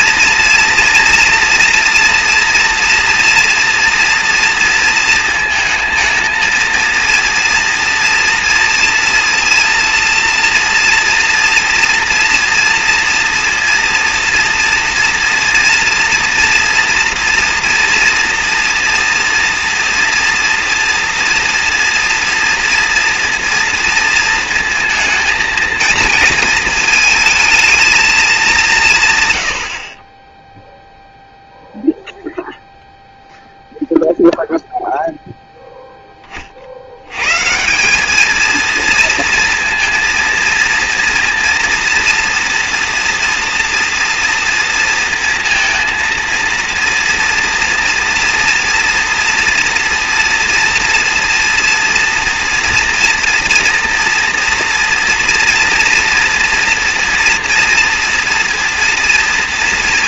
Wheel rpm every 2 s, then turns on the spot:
230, 230, 230, 230, 230, 230, 240, 230, 240, 230, 230, 230, 230, 220, 190, 0, 0, 0, 60, 220, 230, 230, 230, 230, 230, 230, 230, 240, 230, 230.
none